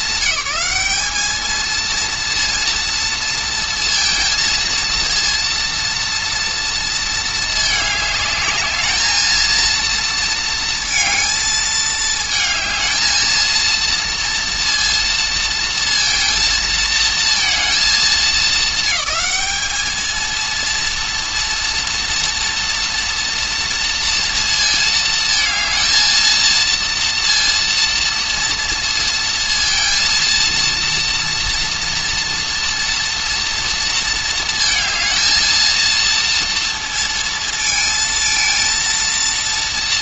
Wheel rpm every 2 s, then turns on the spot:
210, 230, 230, 230, 210, 230, 220, 230, 230, 220, 230, 230, 230, 230, 230, 230, 240, 220, 230, 230.
none